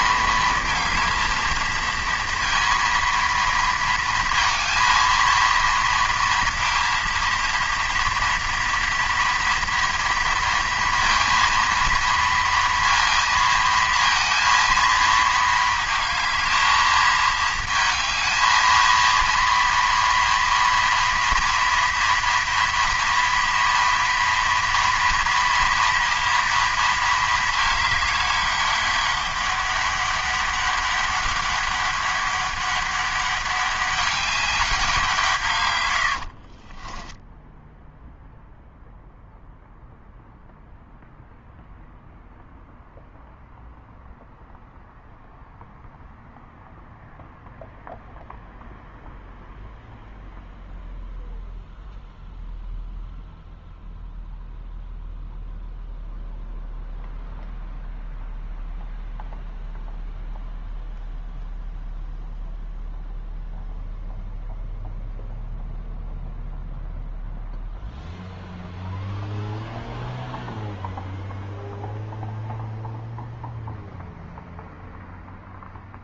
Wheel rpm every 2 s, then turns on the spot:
220, 230, 230, 230, 230, 230, 230, 230, 220, 220, 240, 230, 230, 230, 200, 200, 200, 190, 30, 0, 0, 0, 0, 0, 0, 0, 0, 0, 0, 0, 0, 0, 0, 0, 0, 0, 0, 0.
36-38